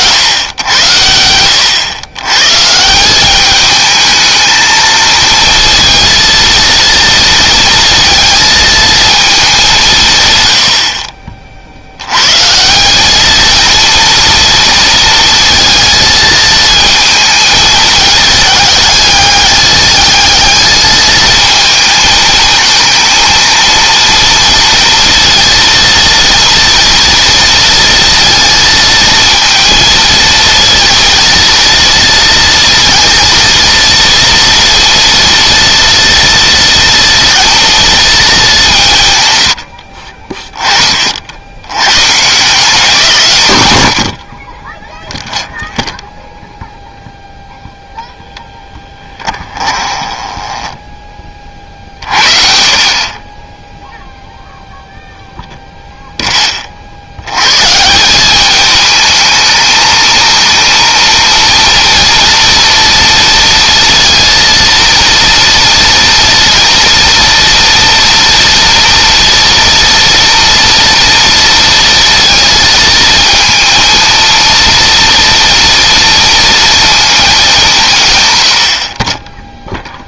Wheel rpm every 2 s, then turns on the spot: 100, 160, 220, 230, 230, 60, 190, 230, 220, 210, 220, 220, 230, 230, 230, 230, 230, 230, 230, 170, 40, 170, 10, 0, 10, 20, 40, 0, 40, 210, 230, 230, 230, 230, 230, 230, 220, 230, 230, 60.
48-52